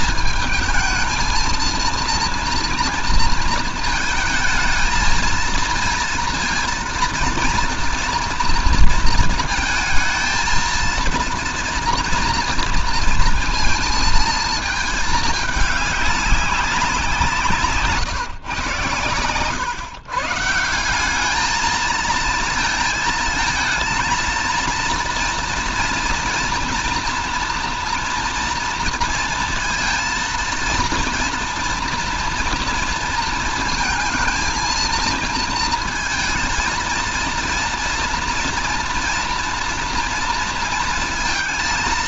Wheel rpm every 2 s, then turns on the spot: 220, 230, 230, 230, 230, 230, 230, 220, 190, 120, 180, 220, 230, 230, 230, 230, 230, 220, 230, 230, 230.
none